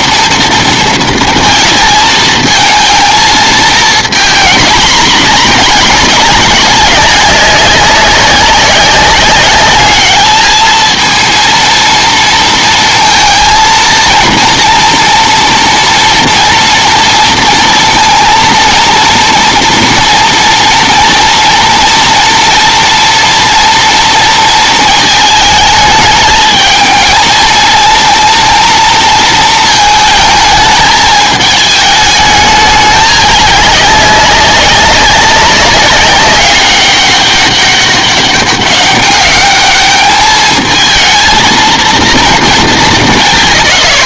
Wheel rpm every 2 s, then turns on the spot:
230, 220, 230, 190, 190, 220, 230, 230, 230, 230, 230, 230, 220, 220, 230, 220, 210, 190, 200, 200, 220, 200.
none